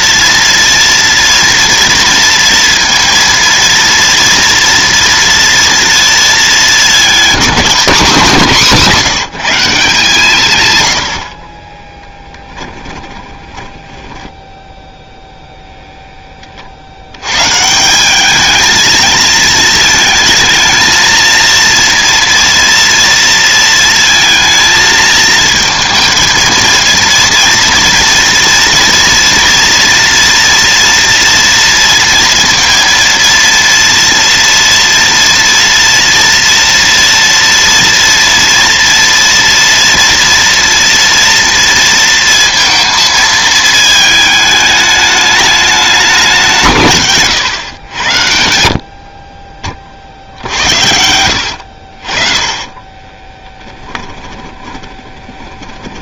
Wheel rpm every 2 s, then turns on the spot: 230, 230, 240, 210, 190, 130, 10, 0, 40, 220, 220, 230, 220, 230, 230, 230, 230, 230, 230, 230, 230, 230, 210, 160, 60, 70, 20, 20.
12-14 50-56